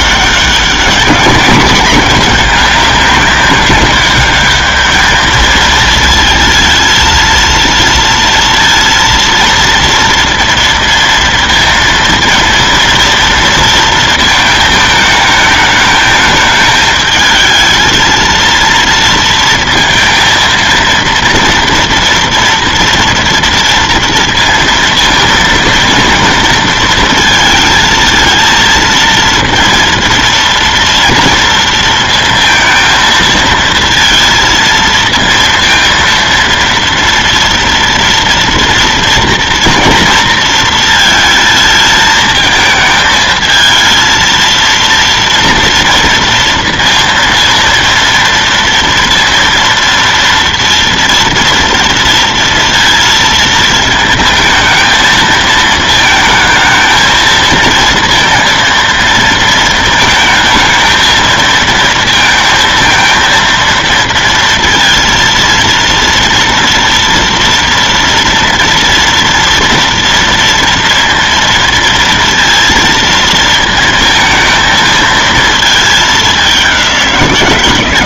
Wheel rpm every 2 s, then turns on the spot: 200, 200, 210, 220, 230, 230, 230, 220, 210, 230, 230, 230, 230, 230, 230, 230, 230, 230, 230, 230, 230, 220, 230, 230, 230, 230, 230, 220, 220, 230, 220, 230, 230, 230, 230, 230, 230, 220, 190.
none